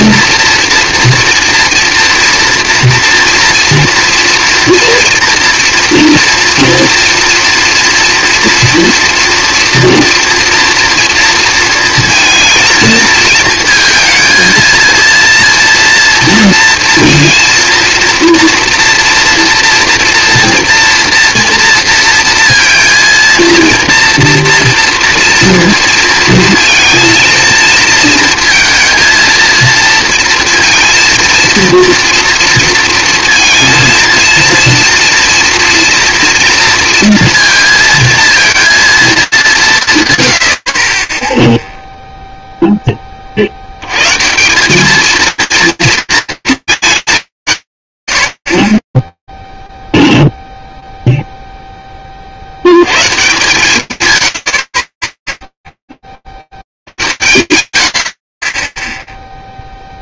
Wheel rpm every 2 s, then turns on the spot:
240, 240, 230, 230, 240, 230, 230, 230, 230, 230, 230, 230, 240, 230, 230, 230, 230, 230, 230, 230, 70, 0, 200, 220, 50, 0, 40, 110, 60, 10.
none